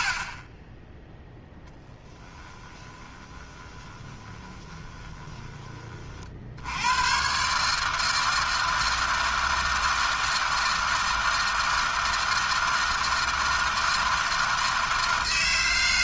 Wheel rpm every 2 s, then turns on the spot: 10, 20, 20, 130, 160, 160, 160, 160.
0-4